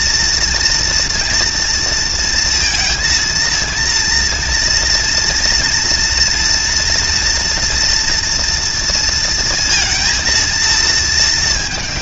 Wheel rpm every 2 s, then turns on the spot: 240, 230, 230, 240, 230, 220.
none